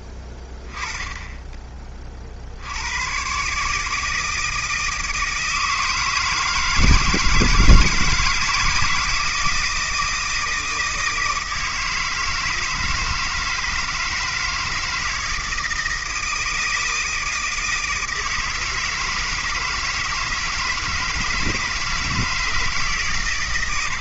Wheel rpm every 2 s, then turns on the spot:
20, 90, 160, 160, 160, 160, 160, 160, 160, 160, 160, 150.
none